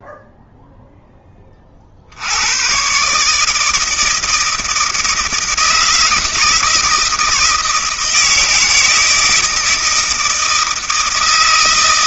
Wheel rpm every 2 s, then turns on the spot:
0, 110, 160, 160, 160, 160.
none